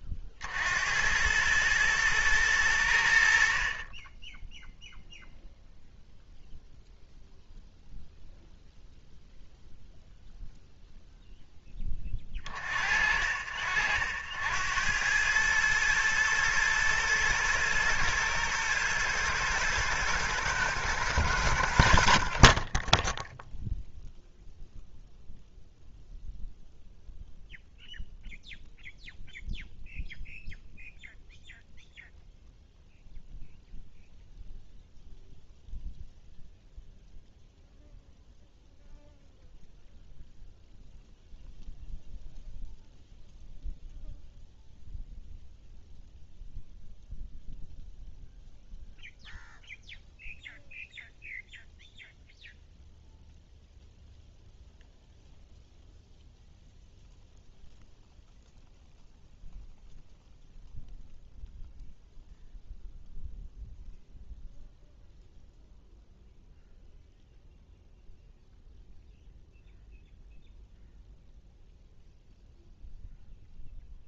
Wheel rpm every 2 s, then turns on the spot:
50, 100, 0, 0, 0, 0, 30, 80, 110, 110, 110, 30, 0, 0, 0, 0, 0, 0, 0, 0, 0, 0, 0, 0, 0, 0, 0, 0, 0, 0, 0, 0, 0, 0, 0, 0, 0.
none